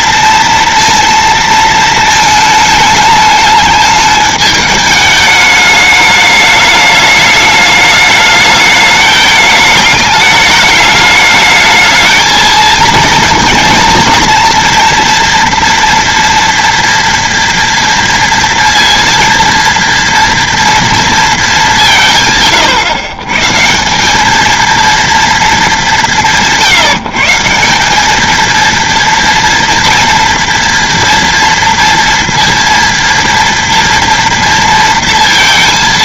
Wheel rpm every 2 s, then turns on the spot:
230, 210, 210, 210, 210, 210, 230, 230, 230, 230, 220, 130, 230, 160, 230, 230, 230, 230.
none